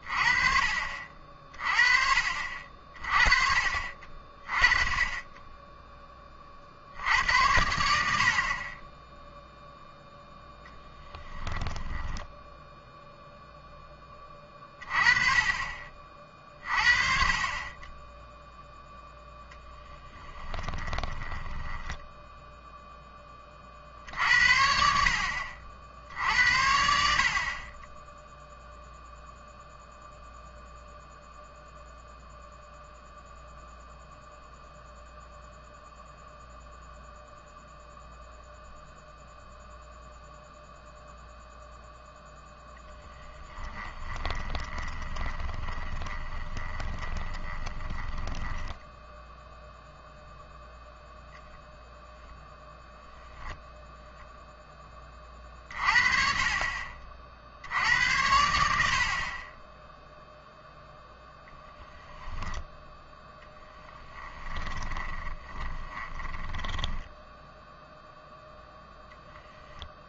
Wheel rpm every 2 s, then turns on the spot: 40, 40, 30, 60, 20, 0, 0, 30, 40, 0, 20, 0, 70, 70, 0, 0, 0, 0, 0, 0, 0, 0, 20, 20, 10, 0, 0, 10, 40, 70, 0, 10, 30, 10, 0.
20-22 44-50 64-68